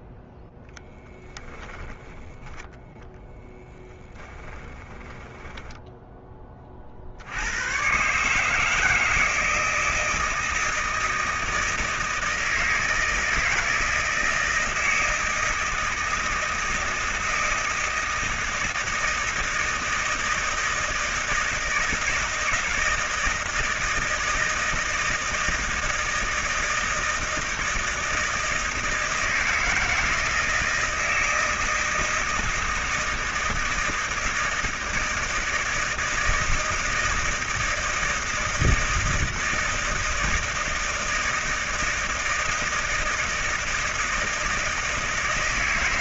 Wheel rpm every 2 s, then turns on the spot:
10, 10, 20, 40, 150, 160, 160, 160, 160, 160, 160, 160, 160, 160, 160, 160, 160, 160, 160, 160, 160, 160, 160.
4-6